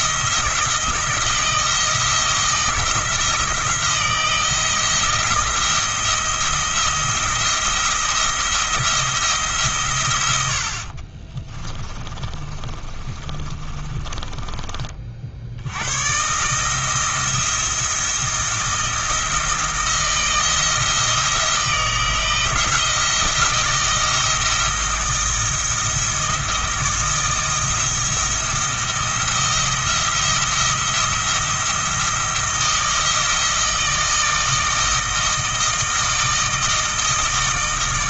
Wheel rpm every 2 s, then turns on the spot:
170, 170, 170, 170, 170, 60, 30, 30, 150, 170, 160, 160, 160, 160, 170, 170, 170, 160, 160.
12-14